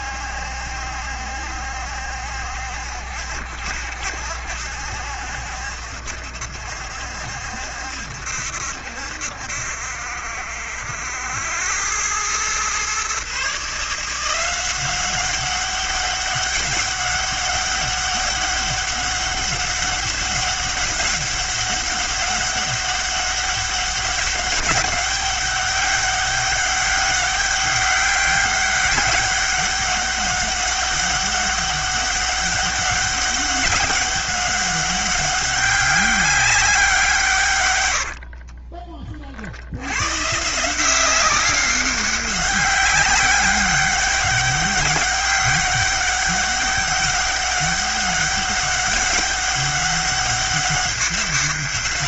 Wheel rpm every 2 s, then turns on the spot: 70, 70, 70, 70, 70, 80, 120, 180, 200, 200, 200, 200, 200, 200, 200, 190, 200, 200, 190, 50, 160, 190, 200, 200, 200, 200.
38-40